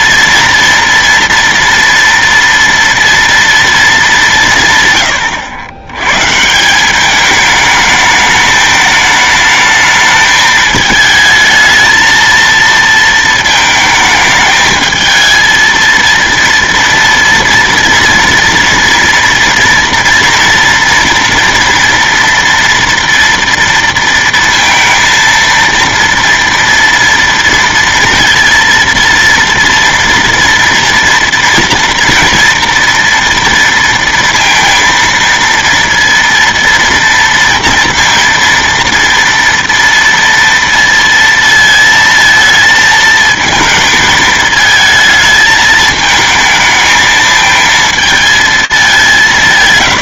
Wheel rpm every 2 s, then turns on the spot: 230, 230, 160, 180, 210, 220, 230, 220, 230, 230, 230, 240, 230, 230, 230, 230, 240, 230, 230, 230, 230, 220, 220, 220, 200.
none